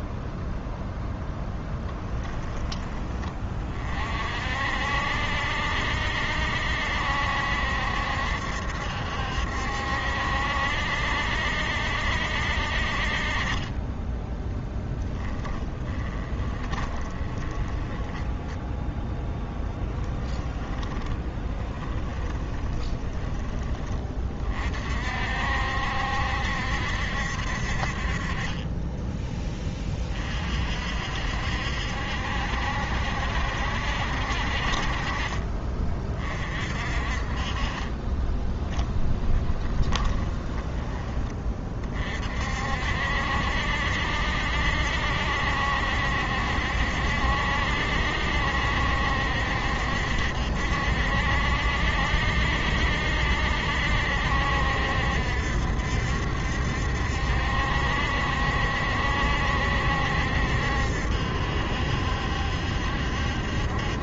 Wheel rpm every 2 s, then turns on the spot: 0, 20, 60, 70, 70, 70, 50, 10, 20, 0, 20, 20, 50, 60, 20, 60, 70, 40, 40, 10, 20, 60, 70, 70, 70, 70, 70, 70, 70, 70, 70, 70.
14-18 20-24 38-40